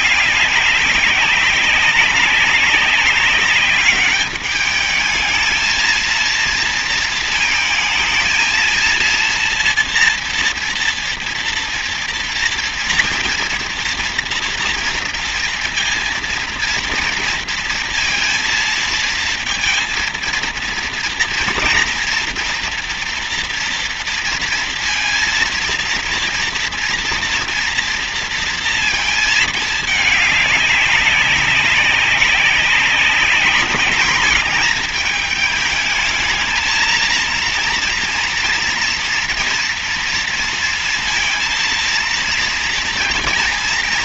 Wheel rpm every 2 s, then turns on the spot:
200, 200, 210, 230, 230, 230, 230, 230, 230, 230, 230, 230, 230, 230, 230, 200, 190, 220, 220, 230, 230, 230.
none